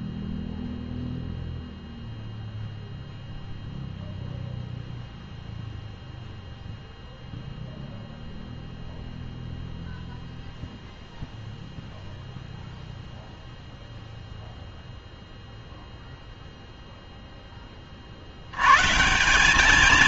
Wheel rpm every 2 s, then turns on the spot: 0, 0, 0, 0, 0, 0, 0, 0, 0, 120.
none